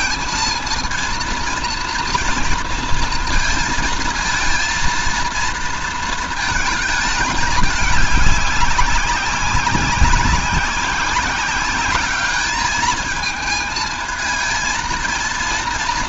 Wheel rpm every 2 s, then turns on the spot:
230, 230, 230, 220, 200, 180, 210, 220.
none